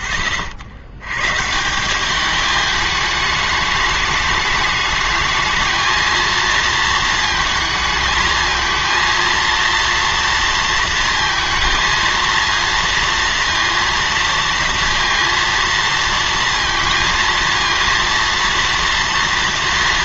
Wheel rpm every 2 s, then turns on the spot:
60, 210, 210, 230, 230, 230, 230, 230, 230, 230.
none